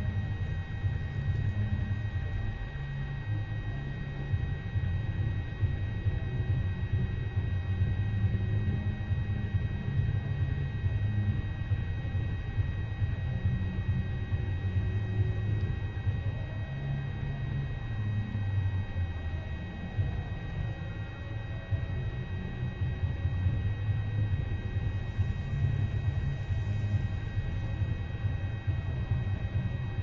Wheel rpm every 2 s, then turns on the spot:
0, 0, 0, 0, 0, 0, 0, 0, 0, 0, 0, 0, 0, 0, 0.
none